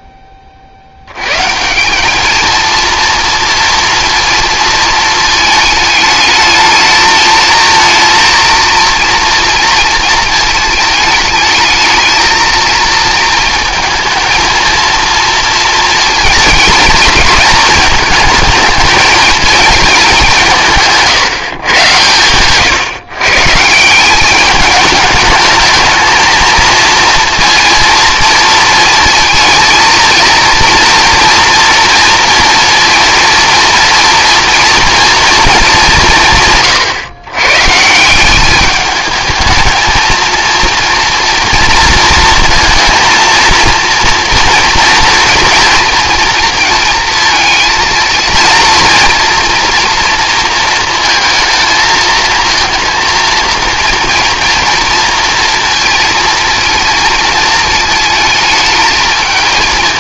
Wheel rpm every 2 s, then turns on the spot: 70, 230, 220, 220, 230, 220, 230, 230, 230, 220, 160, 130, 210, 230, 230, 230, 230, 240, 130, 210, 230, 230, 230, 230, 230, 230, 230, 230, 220, 220.
none